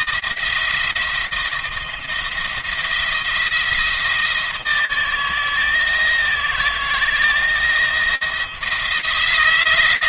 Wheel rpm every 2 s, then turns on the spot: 170, 160, 160, 170, 160.
none